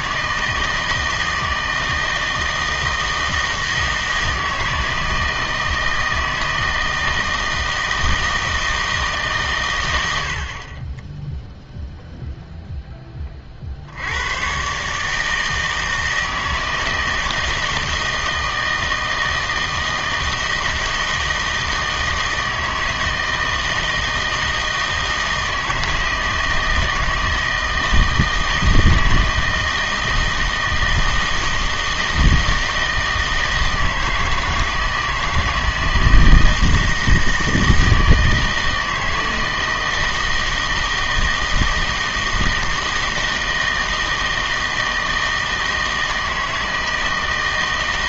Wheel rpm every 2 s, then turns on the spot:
160, 160, 160, 160, 160, 40, 0, 130, 160, 160, 160, 160, 160, 160, 160, 160, 160, 160, 160, 160, 160, 160, 160, 160.
none